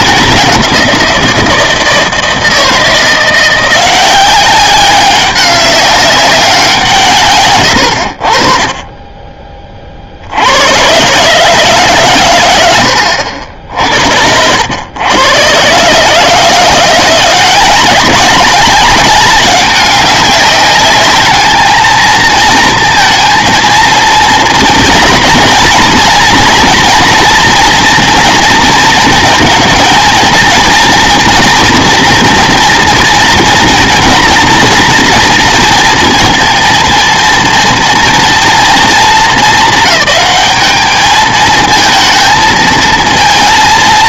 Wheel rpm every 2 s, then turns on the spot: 190, 170, 200, 180, 30, 110, 90, 100, 160, 200, 200, 230, 240, 230, 230, 230, 230, 230, 230, 230, 210, 220.
none